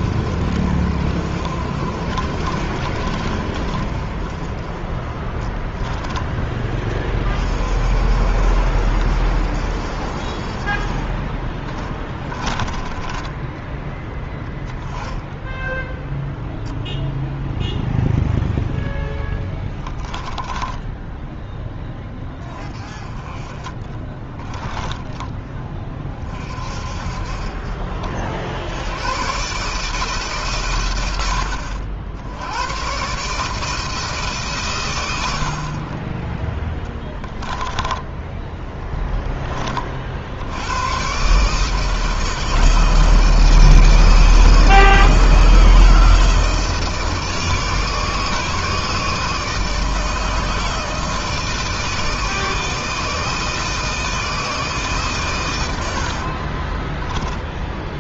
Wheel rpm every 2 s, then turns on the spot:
60, 50, 40, 30, 60, 30, 20, 10, 0, 0, 10, 30, 10, 40, 70, 130, 100, 130, 20, 10, 90, 160, 160, 160, 150, 160, 160, 150, 30.
36-38 56-58